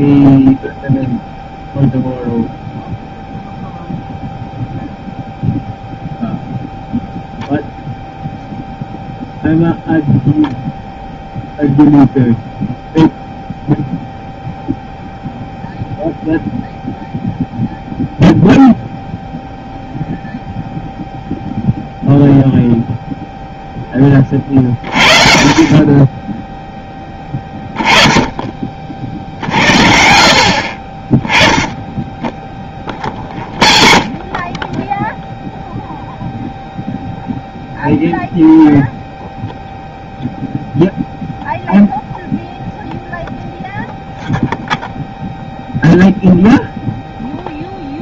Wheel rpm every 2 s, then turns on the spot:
0, 0, 0, 0, 0, 0, 0, 0, 0, 0, 0, 0, 40, 10, 40, 30, 20, 20, 0, 0, 0, 0, 0, 0.
none